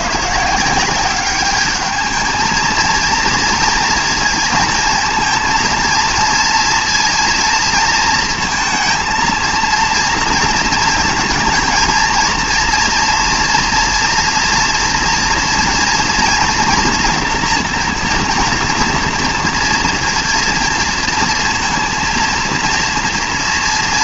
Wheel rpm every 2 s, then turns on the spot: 170, 230, 220, 230, 230, 230, 230, 230, 240, 230, 230, 230.
none